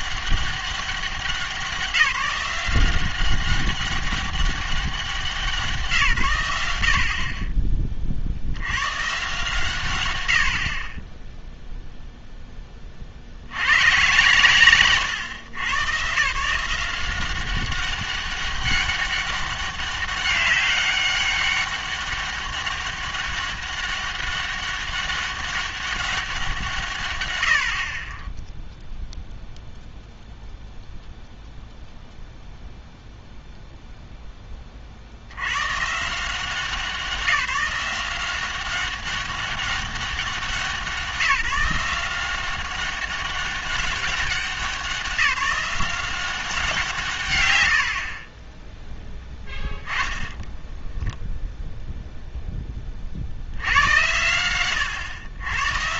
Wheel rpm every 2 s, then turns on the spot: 190, 180, 190, 90, 100, 60, 10, 110, 160, 200, 200, 200, 200, 170, 0, 0, 0, 30, 180, 190, 190, 190, 190, 190, 20, 0, 10, 110.
48-50